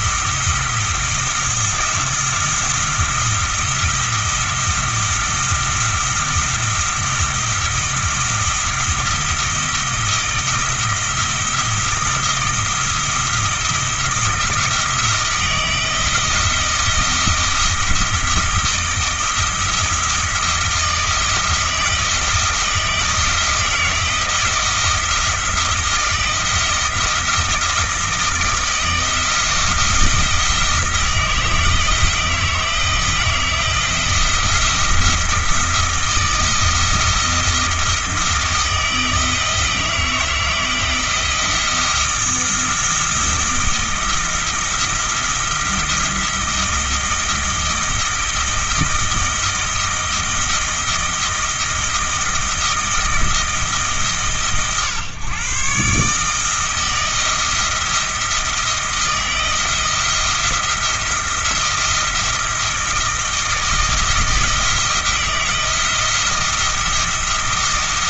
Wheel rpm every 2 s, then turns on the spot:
170, 170, 170, 170, 170, 170, 160, 160, 170, 160, 160, 160, 170, 160, 160, 160, 160, 170, 160, 160, 160, 170, 170, 170, 160, 160, 170, 130, 160, 170, 160, 170, 170, 170.
none